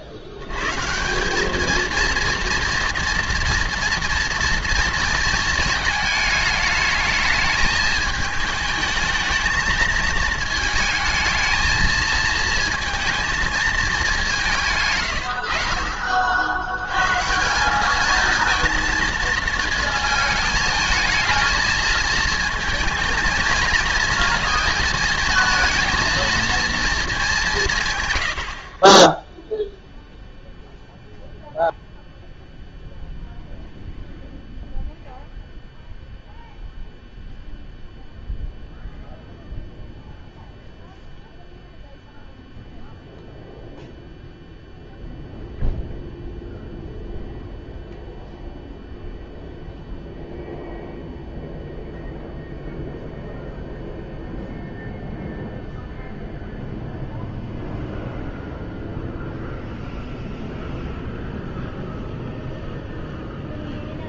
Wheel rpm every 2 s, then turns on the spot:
130, 230, 230, 220, 220, 220, 230, 150, 80, 230, 220, 230, 230, 230, 40, 0, 0, 0, 0, 0, 0, 0, 0, 0, 0, 0, 0, 0, 0, 0, 0, 0.
none